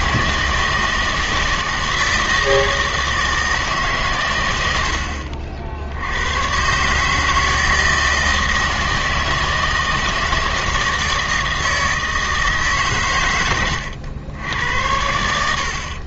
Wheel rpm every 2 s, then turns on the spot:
160, 160, 90, 130, 160, 160, 150, 90.
none